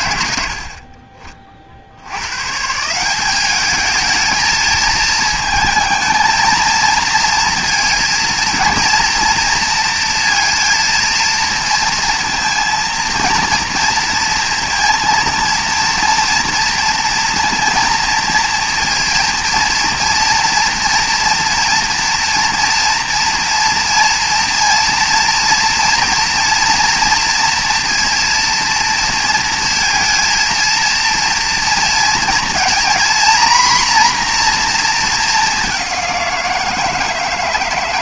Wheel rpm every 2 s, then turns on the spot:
50, 190, 220, 230, 230, 230, 230, 230, 230, 230, 240, 230, 230, 230, 230, 230, 250, 210, 160.
none